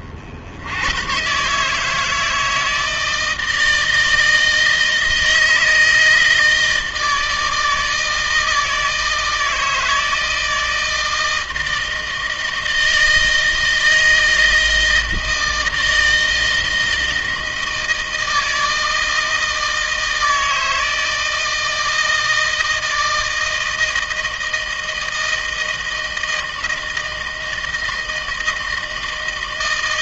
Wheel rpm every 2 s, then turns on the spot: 90, 160, 160, 160, 160, 160, 160, 160, 160, 160, 160, 160, 160, 160, 160.
none